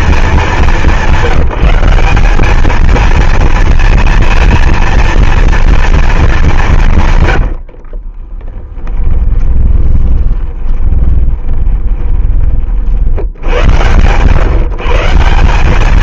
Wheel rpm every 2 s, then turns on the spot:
200, 220, 230, 160, 10, 20, 50, 160.
8-12